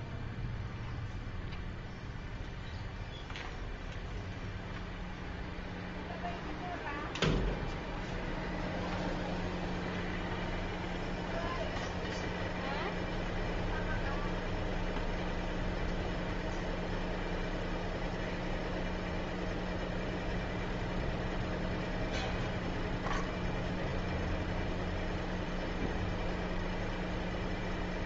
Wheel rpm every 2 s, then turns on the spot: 0, 0, 0, 0, 0, 0, 0, 0, 0, 0, 0, 0, 0, 0.
none